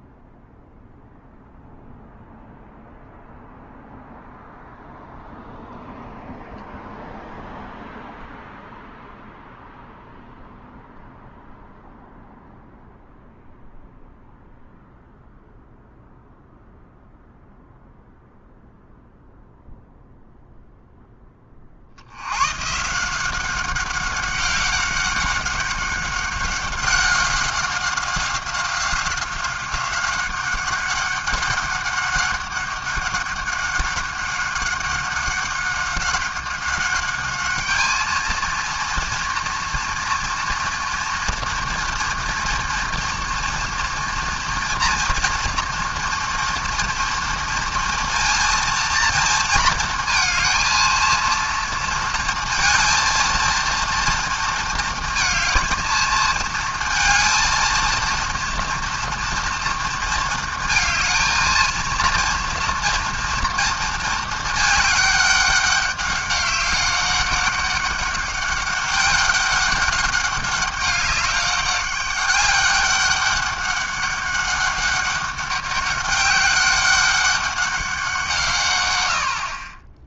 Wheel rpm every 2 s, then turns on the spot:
0, 0, 0, 0, 0, 0, 0, 0, 0, 0, 20, 190, 200, 190, 190, 200, 200, 200, 210, 240, 230, 240, 230, 230, 230, 230, 230, 230, 230, 230, 220, 230, 200, 200, 200, 200, 200, 200, 200, 70.
none